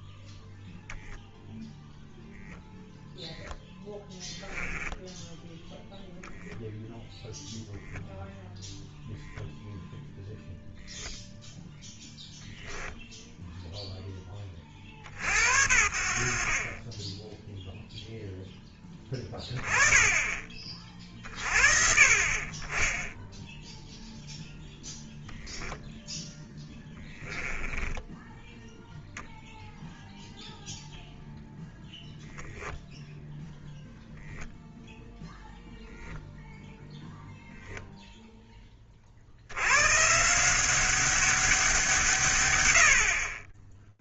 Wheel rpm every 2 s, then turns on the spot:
0, 0, 10, 0, 0, 0, 10, 40, 30, 10, 30, 30, 0, 10, 0, 0, 0, 0, 10, 30, 190, 100.
4-6 26-28